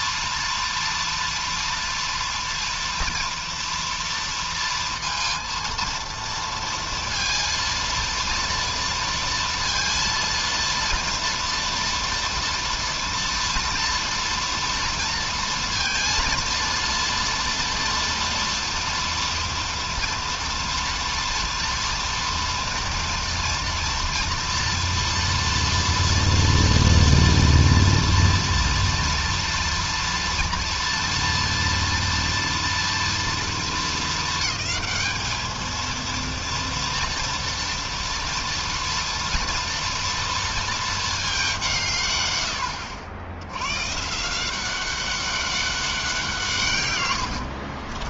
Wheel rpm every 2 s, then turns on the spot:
230, 230, 230, 230, 230, 230, 230, 240, 230, 230, 230, 230, 230, 240, 230, 230, 230, 220, 230, 230, 230, 90, 180, 150.
none